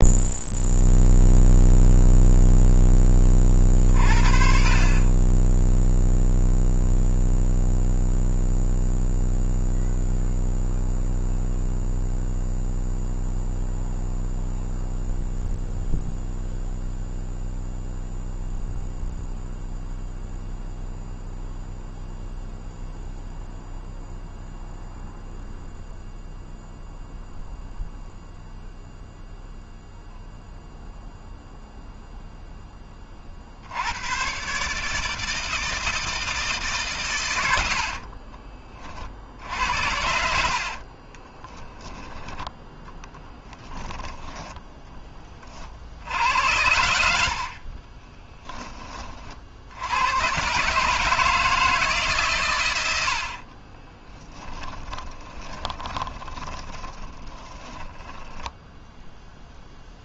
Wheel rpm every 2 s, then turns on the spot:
0, 0, 40, 0, 0, 0, 0, 0, 0, 0, 0, 0, 0, 0, 0, 0, 0, 120, 160, 50, 60, 0, 20, 80, 20, 120, 130, 10, 20, 10.
38-42 54-58